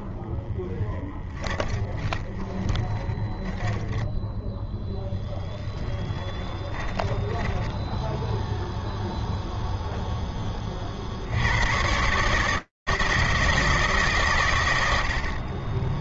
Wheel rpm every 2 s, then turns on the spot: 20, 20, 10, 10, 0, 90, 160, 130.
0-8